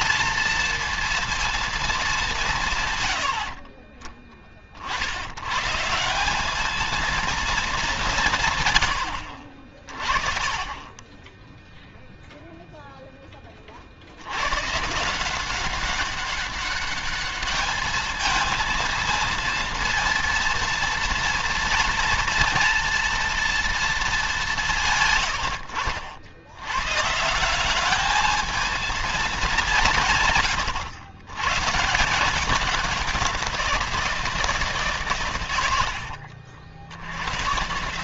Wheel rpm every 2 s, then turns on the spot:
230, 140, 70, 210, 100, 10, 0, 150, 200, 230, 230, 230, 130, 130, 220, 100, 190, 140, 80.
none